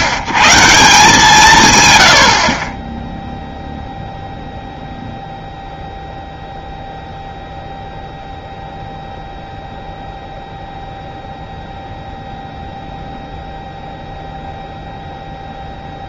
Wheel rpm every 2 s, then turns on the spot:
120, 40, 0, 0, 0, 0, 0, 0.
none